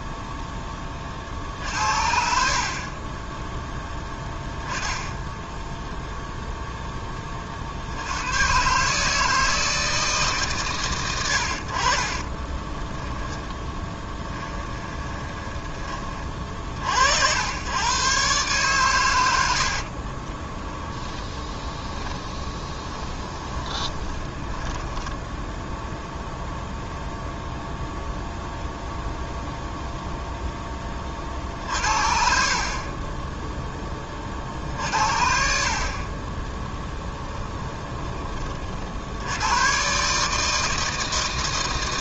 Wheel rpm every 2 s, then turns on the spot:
20, 40, 10, 0, 130, 120, 10, 20, 50, 130, 20, 30, 10, 0, 0, 20, 40, 50, 20, 50, 160.
12-16 20-26 36-38